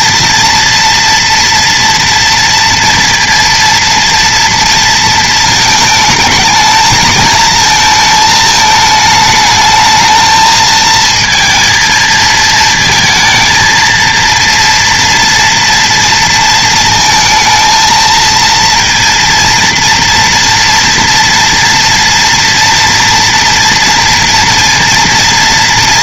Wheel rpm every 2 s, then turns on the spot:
230, 230, 230, 220, 220, 220, 220, 230, 230, 230, 230, 230, 230.
none